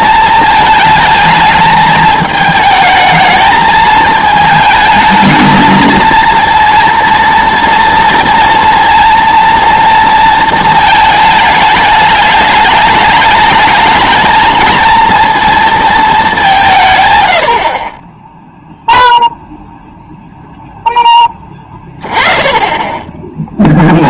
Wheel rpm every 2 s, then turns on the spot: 220, 220, 220, 230, 230, 220, 210, 220, 170, 0, 0, 20.
none